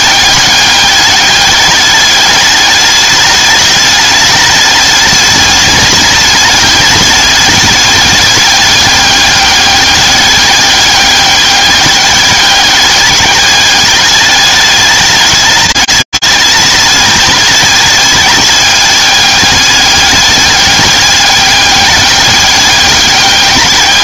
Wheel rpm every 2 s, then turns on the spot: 200, 210, 210, 210, 210, 200, 200, 210, 210, 210, 200, 200.
none